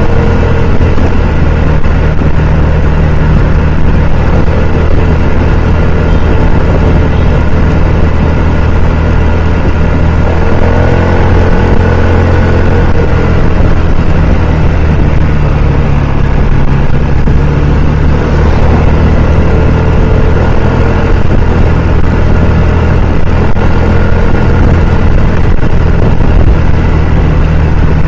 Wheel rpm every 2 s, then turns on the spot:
0, 0, 0, 0, 0, 0, 0, 0, 0, 0, 0, 0, 0, 0.
none